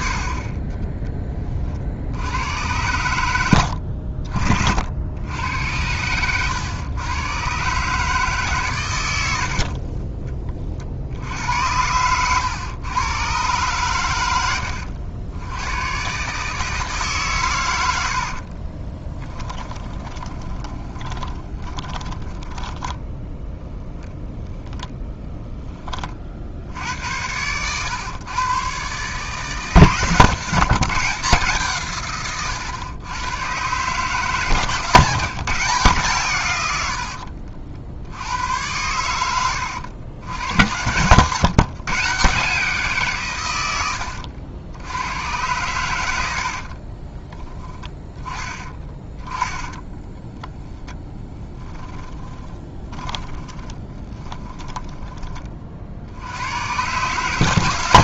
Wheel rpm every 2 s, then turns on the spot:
40, 100, 60, 100, 130, 50, 110, 80, 150, 20, 20, 10, 10, 70, 140, 170, 110, 160, 90, 90, 110, 160, 90, 40, 20, 10, 30, 20, 130.
18-24 36-38 46-50 52-56